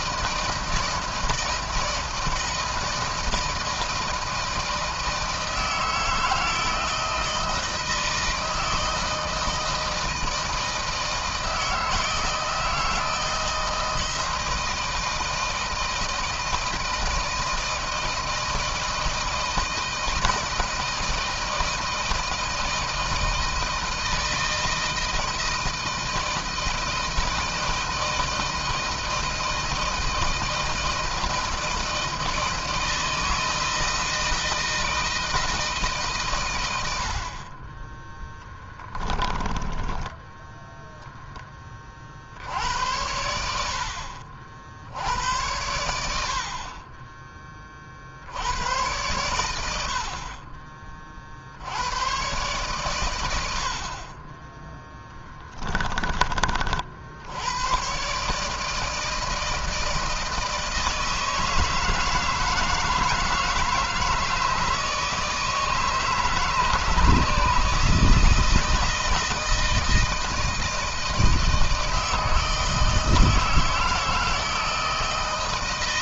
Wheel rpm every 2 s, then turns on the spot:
160, 160, 160, 160, 160, 160, 160, 160, 160, 160, 160, 170, 160, 160, 160, 160, 160, 160, 120, 10, 10, 50, 60, 70, 70, 50, 110, 20, 30, 140, 160, 160, 160, 150, 160, 160, 160, 160.
38-42